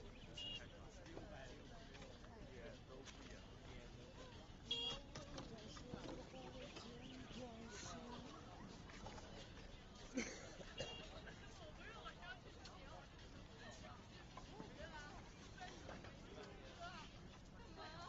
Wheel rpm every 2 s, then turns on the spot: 0, 0, 0, 0, 0, 0, 0, 0, 0.
none